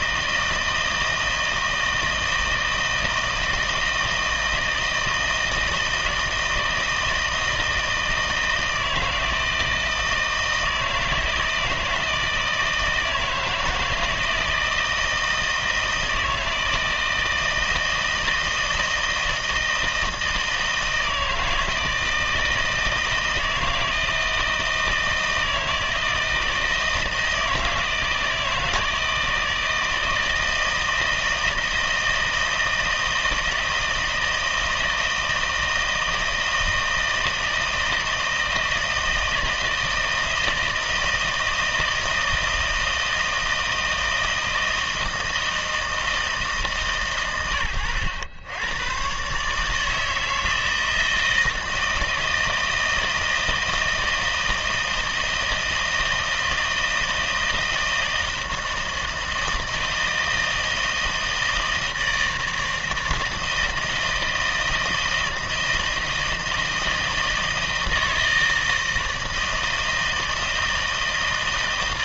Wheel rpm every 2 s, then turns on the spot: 160, 160, 160, 160, 160, 160, 160, 160, 160, 160, 160, 160, 160, 160, 160, 160, 160, 160, 160, 160, 160, 160, 160, 150, 110, 160, 160, 160, 160, 160, 160, 160, 160, 160, 160, 160.
none